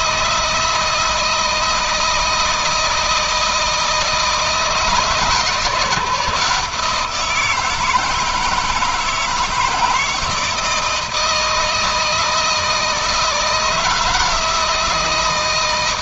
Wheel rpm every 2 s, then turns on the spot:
160, 160, 160, 170, 160, 160, 160, 160.
none